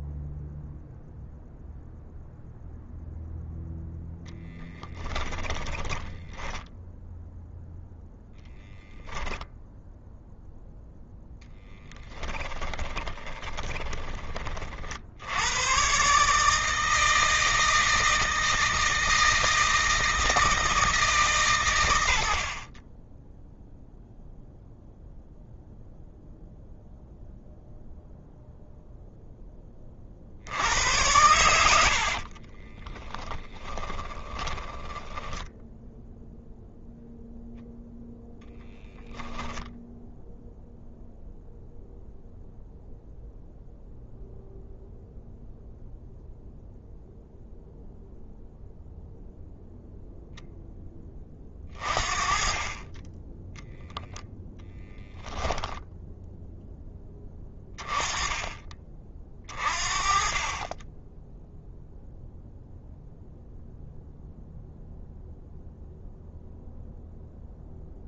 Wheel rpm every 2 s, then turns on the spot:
0, 0, 10, 0, 0, 0, 10, 50, 160, 160, 160, 20, 0, 0, 0, 80, 10, 10, 0, 0, 0, 0, 0, 0, 0, 10, 20, 10, 10, 30, 20, 0, 0, 0.
4-6 12-14 32-36 54-56